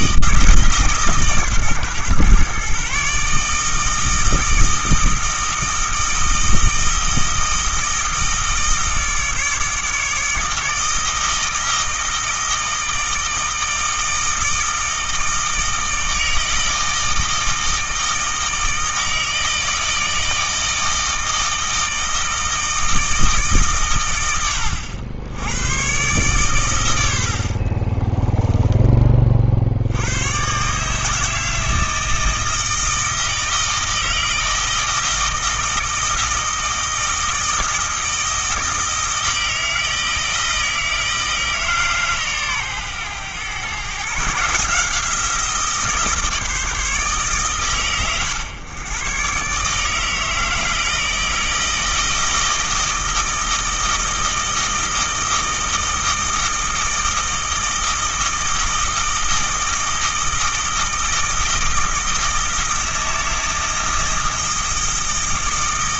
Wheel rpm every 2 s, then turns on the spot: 150, 130, 160, 160, 160, 160, 160, 160, 160, 160, 160, 160, 80, 110, 20, 140, 160, 160, 160, 160, 160, 120, 160, 160, 120, 160, 160, 160, 160, 160, 160, 160, 160.
28-30